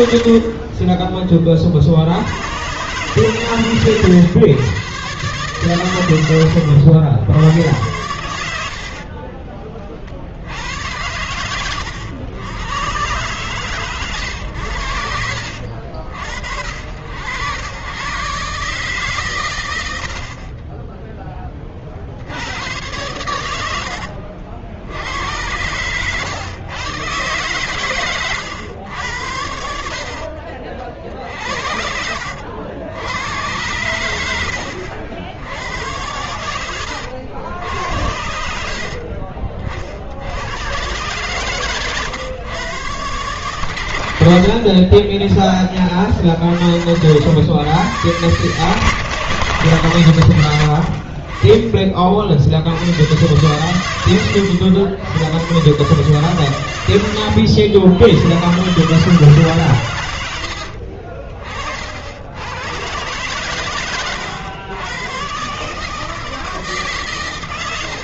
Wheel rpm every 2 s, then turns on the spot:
20, 120, 130, 100, 60, 100, 110, 100, 70, 140, 20, 100, 80, 120, 90, 50, 70, 70, 80, 50, 110, 130, 50, 60, 130, 60, 90, 100, 100, 130, 50, 110, 110, 150.
8-10 30-32 60-62